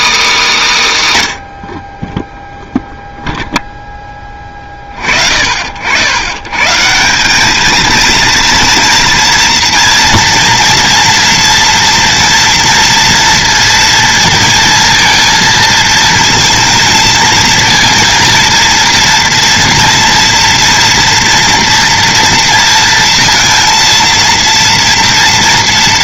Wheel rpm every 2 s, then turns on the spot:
220, 0, 30, 140, 230, 230, 240, 230, 230, 230, 230, 230, 230.
none